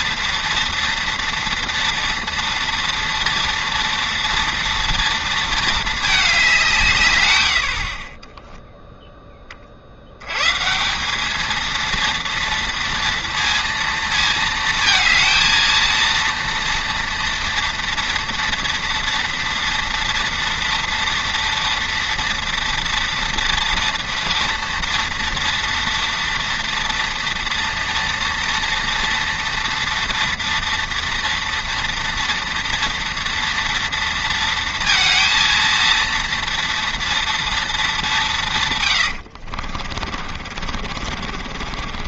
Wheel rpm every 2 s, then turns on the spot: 230, 230, 230, 170, 0, 150, 230, 220, 230, 230, 230, 230, 230, 230, 230, 230, 230, 230, 230, 150, 50.
40-42